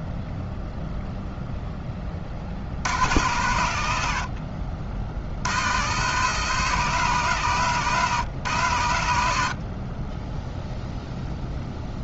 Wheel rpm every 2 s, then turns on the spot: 0, 70, 50, 140, 100, 0.
none